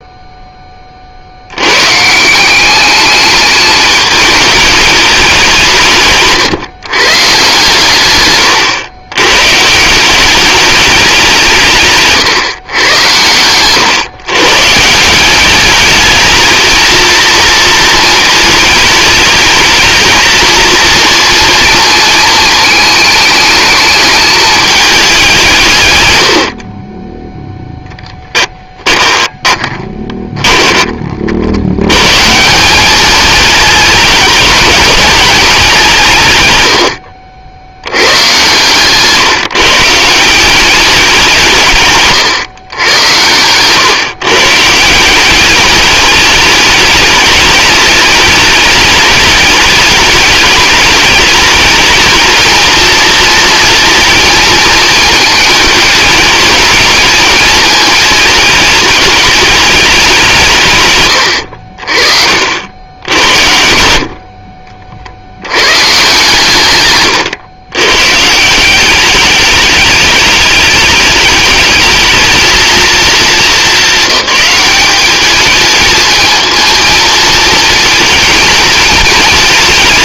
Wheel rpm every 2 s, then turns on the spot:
20, 190, 210, 140, 110, 200, 120, 140, 220, 210, 230, 220, 210, 50, 20, 20, 200, 210, 110, 130, 190, 100, 150, 210, 210, 210, 230, 230, 210, 220, 140, 70, 40, 140, 180, 210, 230, 200, 230, 230.
28-30 64-66